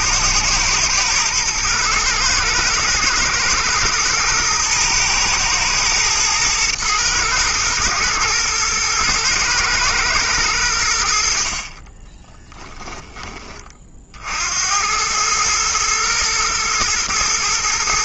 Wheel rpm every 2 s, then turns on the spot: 110, 110, 120, 110, 110, 80, 10, 90, 120.
12-14